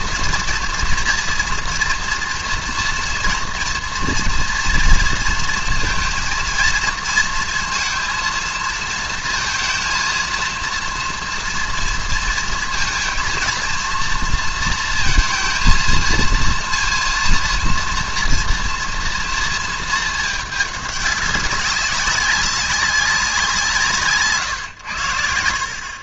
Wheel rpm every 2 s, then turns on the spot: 240, 240, 230, 220, 230, 230, 230, 230, 230, 240, 210, 190, 120.
24-26